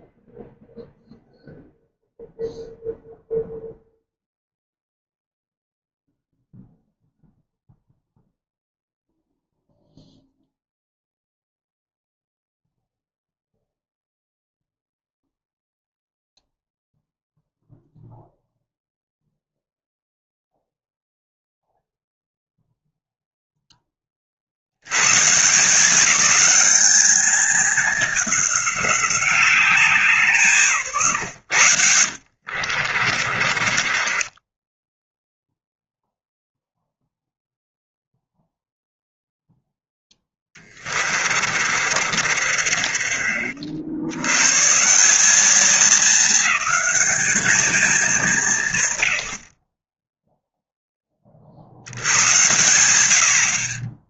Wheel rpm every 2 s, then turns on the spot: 0, 0, 0, 0, 0, 0, 0, 0, 0, 0, 0, 0, 100, 210, 200, 140, 50, 10, 0, 0, 30, 40, 150, 200, 130, 10, 90.
32-36 40-44